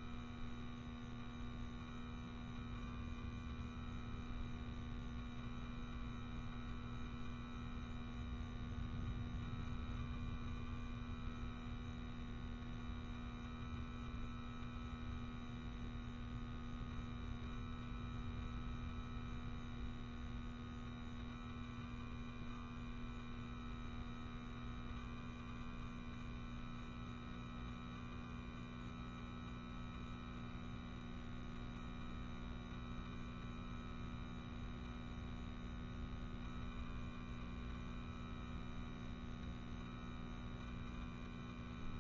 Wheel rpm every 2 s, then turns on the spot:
0, 0, 0, 0, 0, 0, 0, 0, 0, 0, 0, 0, 0, 0, 0, 0, 0, 0, 0, 0, 0.
none